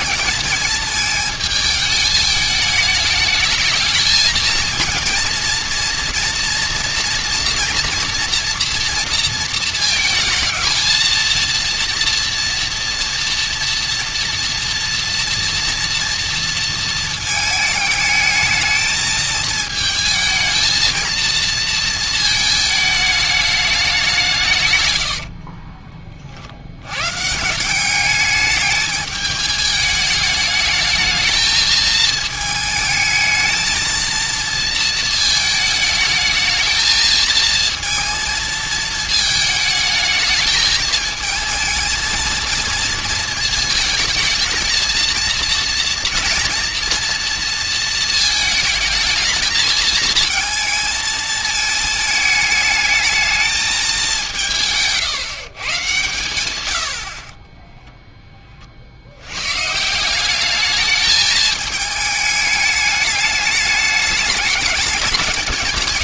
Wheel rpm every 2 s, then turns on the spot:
220, 210, 220, 240, 240, 220, 240, 240, 230, 220, 220, 220, 130, 80, 210, 210, 220, 230, 220, 220, 220, 230, 230, 230, 220, 220, 220, 150, 100, 30, 210, 210, 210.
none